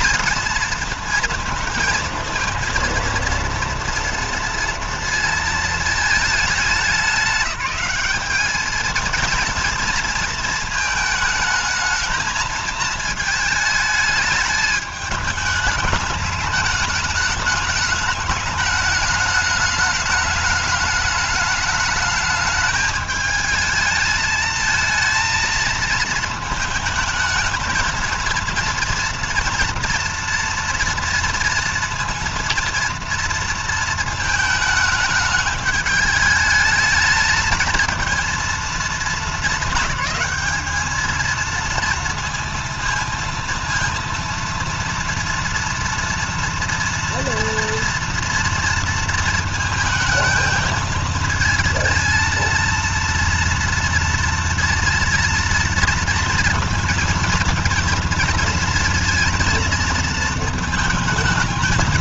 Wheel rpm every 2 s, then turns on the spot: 230, 230, 230, 210, 220, 220, 220, 210, 210, 210, 210, 220, 220, 220, 230, 230, 230, 220, 210, 230, 220, 230, 230, 230, 230, 220, 230, 230, 230, 230, 220.
none